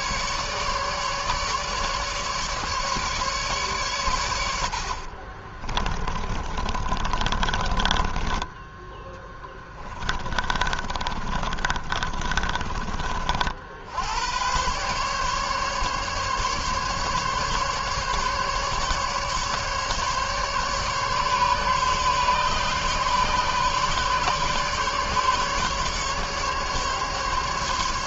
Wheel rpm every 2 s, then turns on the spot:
150, 150, 100, 30, 20, 30, 40, 110, 140, 140, 140, 140, 140, 150.
6-8 10-14